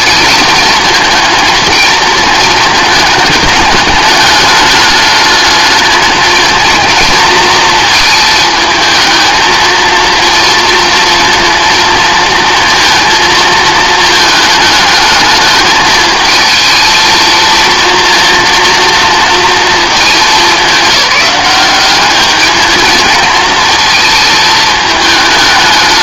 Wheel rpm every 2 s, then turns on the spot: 220, 220, 210, 230, 220, 230, 230, 220, 220, 230, 200, 210, 220.
none